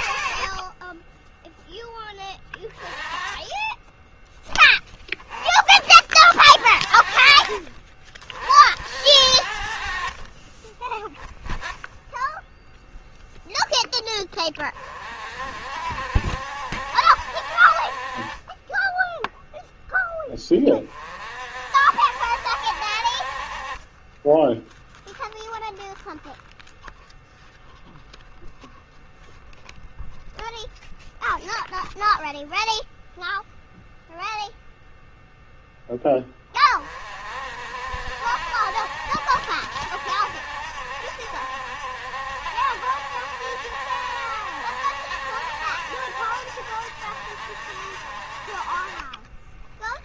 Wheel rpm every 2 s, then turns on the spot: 30, 20, 0, 50, 60, 20, 0, 30, 70, 20, 30, 60, 10, 0, 0, 0, 0, 0, 30, 70, 70, 70, 70, 70, 40.
none